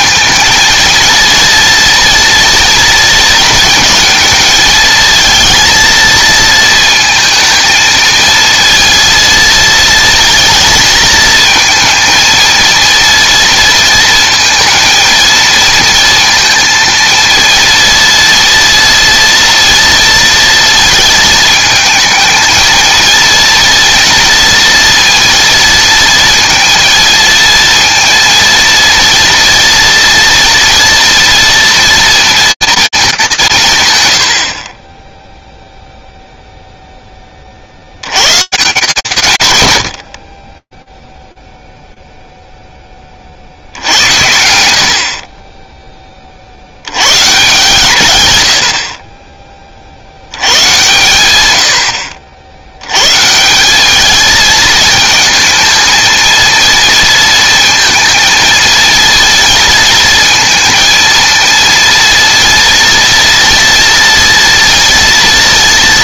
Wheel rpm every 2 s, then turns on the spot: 230, 230, 220, 230, 230, 230, 230, 230, 230, 230, 230, 220, 240, 230, 230, 230, 230, 50, 0, 170, 20, 20, 60, 130, 40, 90, 170, 220, 230, 230, 230, 230, 230.
none